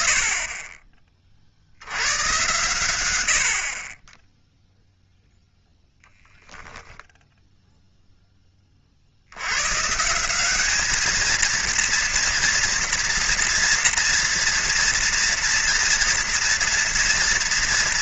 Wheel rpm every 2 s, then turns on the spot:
50, 20, 0, 20, 190, 230, 230, 230, 230.
none